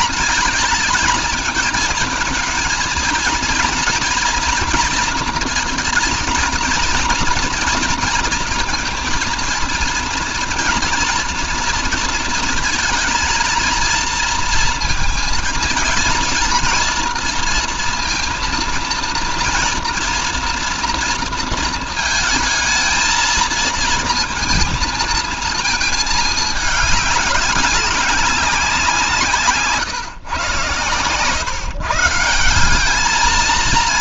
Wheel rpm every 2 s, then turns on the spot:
220, 240, 230, 230, 230, 230, 220, 230, 230, 230, 230, 230, 220, 200, 150, 130, 220.
none